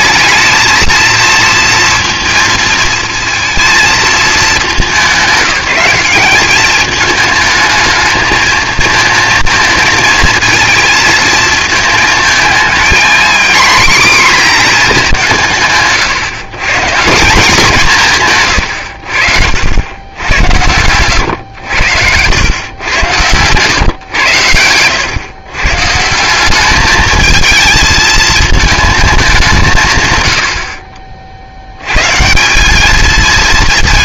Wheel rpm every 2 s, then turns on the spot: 220, 230, 210, 200, 220, 230, 220, 230, 140, 110, 100, 100, 100, 200, 220, 50, 190.
none